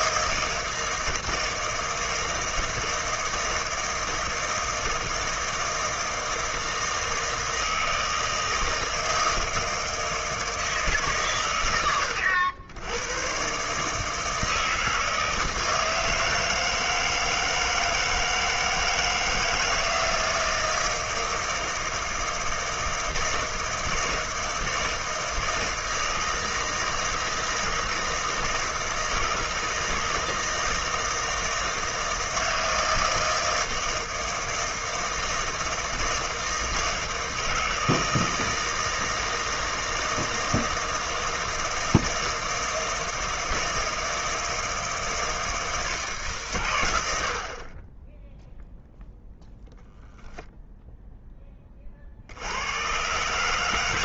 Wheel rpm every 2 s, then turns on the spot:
160, 160, 160, 160, 160, 160, 90, 160, 160, 160, 160, 160, 160, 160, 160, 160, 160, 160, 160, 160, 160, 160, 160, 120, 0, 0, 100.
none